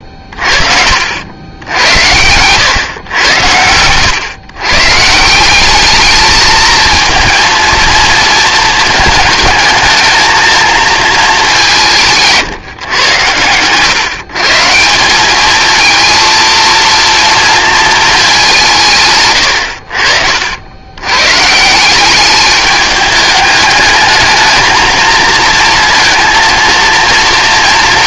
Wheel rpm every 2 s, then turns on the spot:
60, 120, 140, 220, 220, 230, 130, 170, 230, 170, 90, 210, 220, 230.
none